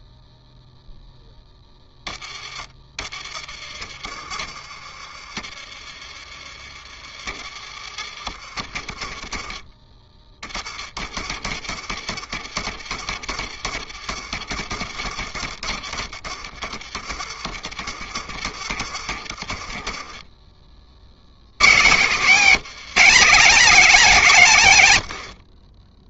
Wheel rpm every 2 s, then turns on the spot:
0, 30, 40, 40, 40, 30, 60, 50, 40, 50, 40, 220, 140.
8-10 24-26